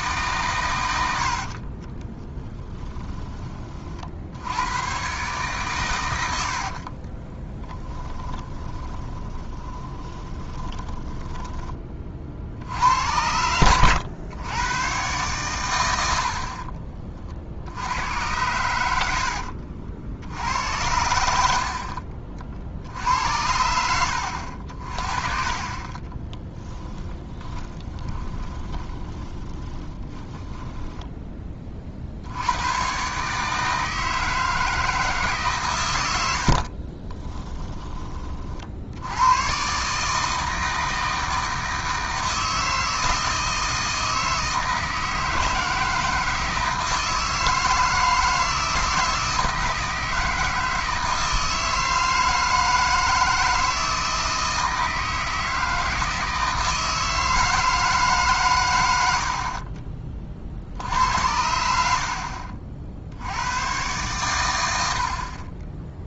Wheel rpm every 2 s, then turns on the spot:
90, 10, 120, 40, 30, 20, 90, 120, 30, 90, 90, 70, 50, 10, 20, 10, 120, 160, 40, 80, 160, 160, 160, 160, 160, 160, 160, 160, 160, 90, 70, 60, 70.
2-4 6-12 16-18 26-30 36-38